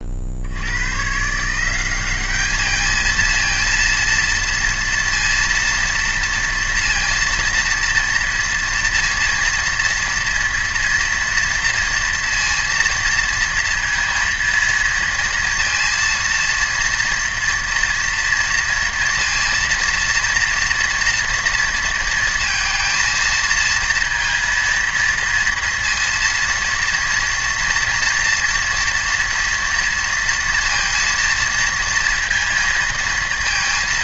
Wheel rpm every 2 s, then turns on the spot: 90, 210, 230, 230, 230, 230, 230, 230, 230, 230, 230, 230, 230, 230, 230, 230, 230.
none